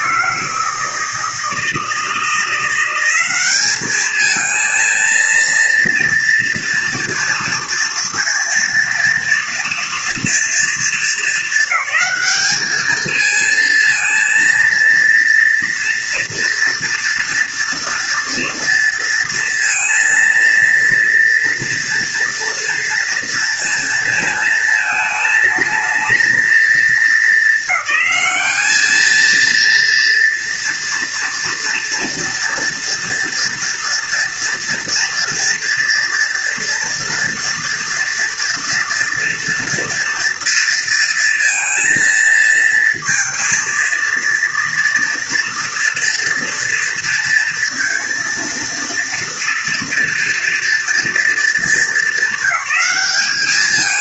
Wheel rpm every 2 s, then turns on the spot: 160, 180, 230, 230, 230, 230, 220, 230, 230, 230, 230, 230, 220, 220, 220, 230, 230, 230, 230, 230, 230, 230, 230, 230, 230, 230, 200.
none